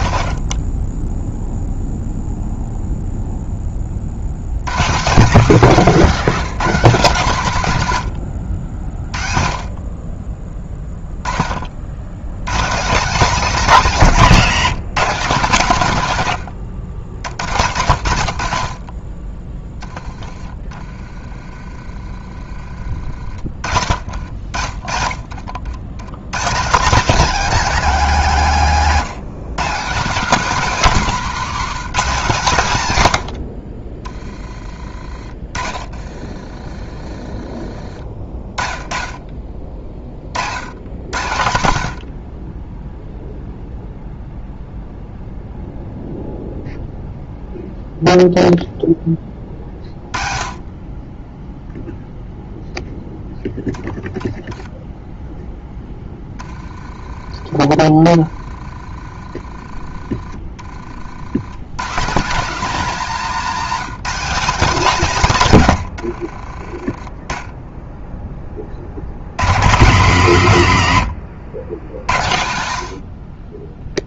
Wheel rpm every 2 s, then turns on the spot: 20, 0, 160, 200, 60, 10, 210, 190, 70, 30, 30, 40, 50, 180, 160, 220, 130, 30, 30, 30, 90, 0, 0, 0, 10, 20, 0, 0, 20, 30, 40, 210, 170, 10, 80, 120, 60.
24-26 34-36